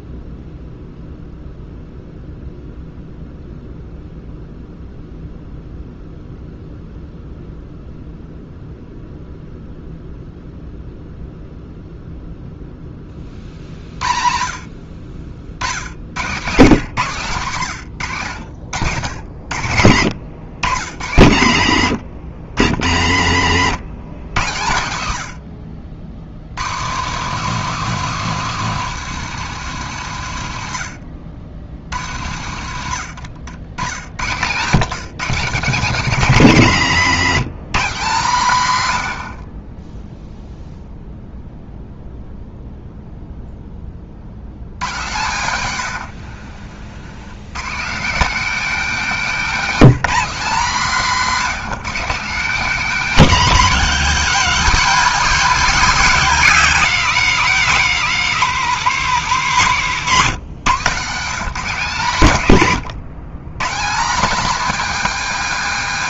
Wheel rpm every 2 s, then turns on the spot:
0, 0, 0, 0, 0, 0, 10, 50, 130, 90, 90, 80, 90, 150, 210, 90, 90, 140, 150, 120, 0, 0, 110, 70, 240, 210, 200, 170, 200, 210, 170, 150, 260.
none